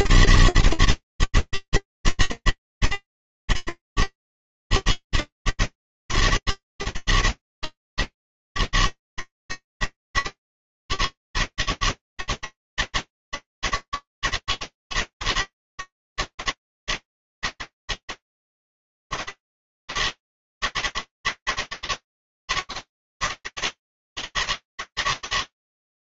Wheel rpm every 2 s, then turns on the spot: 160, 160, 160, 160, 160, 160, 160, 160, 160, 160, 160, 150, 150.
none